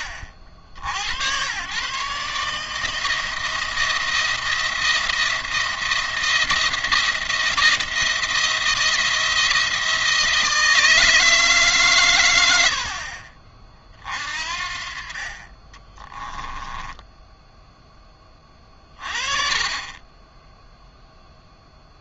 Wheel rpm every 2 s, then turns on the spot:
70, 160, 170, 170, 170, 160, 70, 50, 10, 30, 0.
16-18